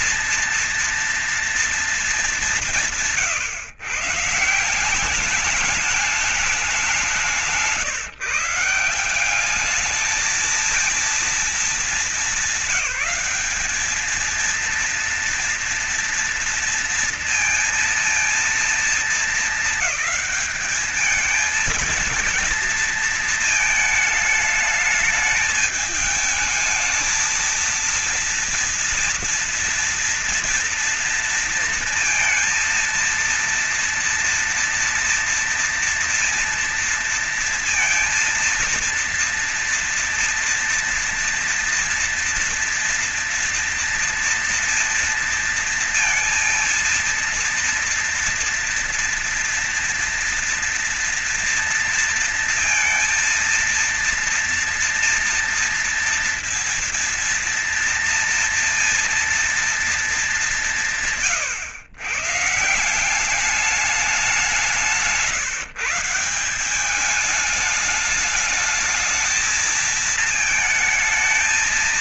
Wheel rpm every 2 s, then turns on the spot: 230, 190, 180, 200, 170, 220, 210, 230, 230, 230, 220, 230, 210, 220, 230, 240, 230, 230, 230, 230, 230, 230, 230, 230, 230, 230, 230, 230, 230, 240, 170, 160, 170, 190, 220, 220.
none